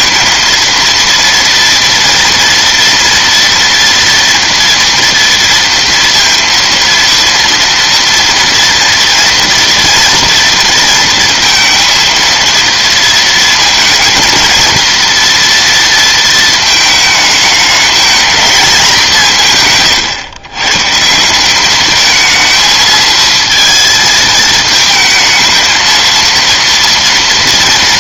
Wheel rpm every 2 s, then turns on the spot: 230, 230, 230, 230, 230, 230, 230, 230, 220, 210, 130, 220, 220, 230.
none